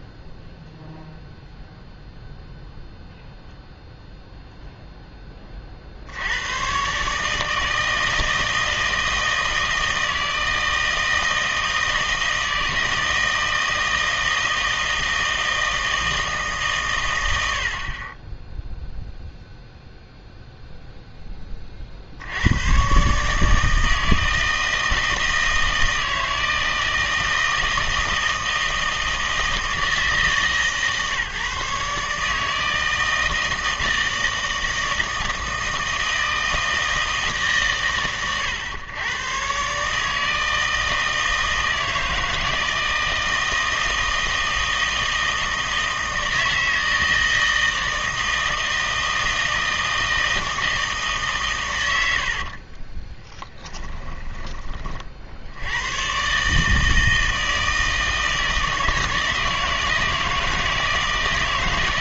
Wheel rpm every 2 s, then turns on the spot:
0, 0, 0, 120, 160, 160, 160, 160, 140, 0, 0, 110, 160, 160, 160, 150, 160, 160, 160, 110, 160, 160, 160, 160, 160, 160, 30, 40, 150, 160, 160.
52-54